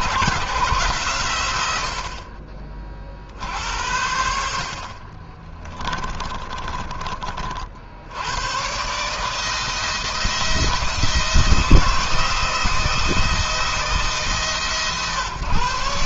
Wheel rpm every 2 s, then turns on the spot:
140, 50, 40, 30, 140, 170, 170, 130.
4-6